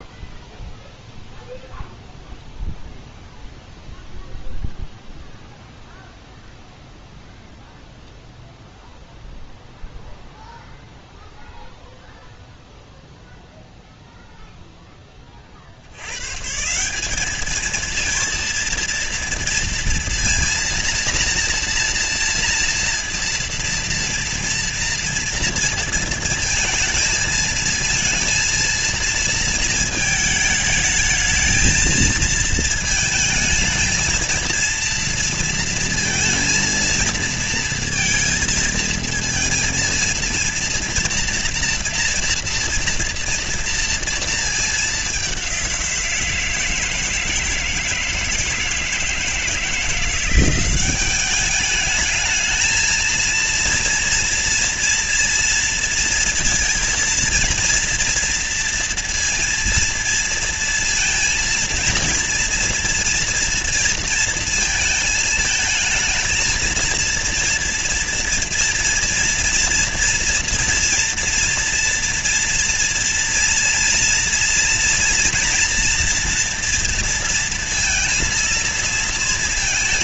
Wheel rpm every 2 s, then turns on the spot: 0, 0, 0, 0, 0, 0, 0, 10, 180, 230, 230, 230, 230, 230, 230, 220, 220, 230, 230, 230, 240, 240, 210, 160, 160, 190, 230, 230, 230, 230, 230, 230, 230, 230, 230, 230, 230, 240, 230, 220.
none